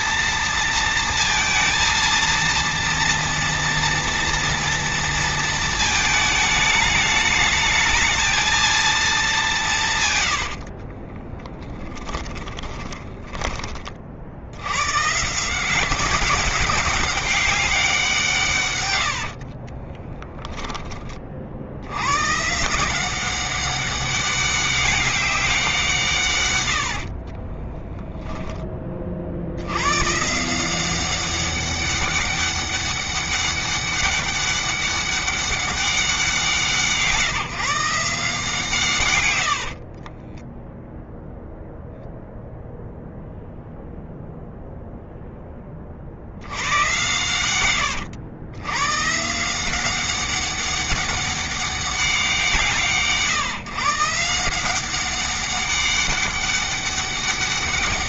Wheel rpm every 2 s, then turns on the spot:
230, 230, 230, 220, 210, 30, 20, 140, 200, 70, 30, 180, 200, 50, 40, 190, 200, 200, 160, 120, 0, 0, 10, 120, 140, 200, 150, 190, 200.
10-12 18-20 26-28 38-40